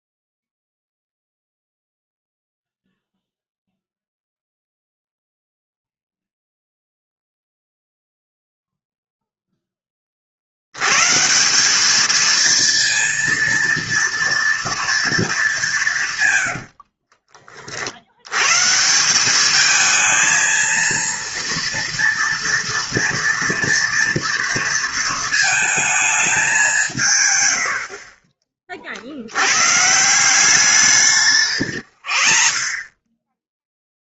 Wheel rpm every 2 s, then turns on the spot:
0, 0, 0, 0, 0, 80, 220, 230, 90, 120, 230, 230, 230, 190, 40, 170, 40.
16-18 32-34